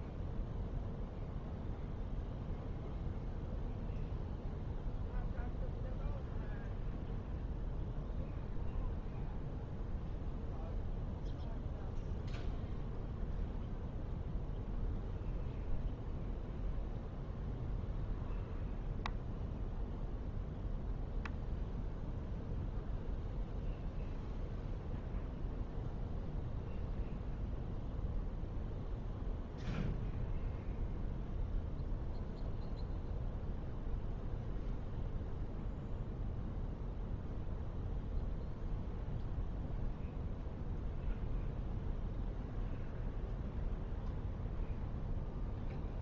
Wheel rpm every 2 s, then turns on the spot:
0, 0, 0, 0, 0, 0, 0, 0, 0, 0, 0, 0, 0, 0, 0, 0, 0, 0, 0, 0, 0, 0, 0.
none